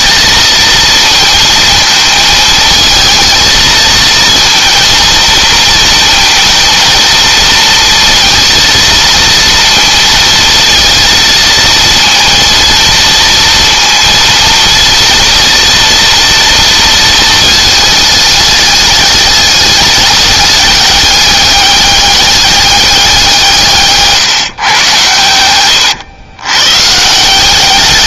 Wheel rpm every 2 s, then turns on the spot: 220, 220, 230, 230, 230, 230, 230, 230, 230, 210, 200, 200, 130, 130.
none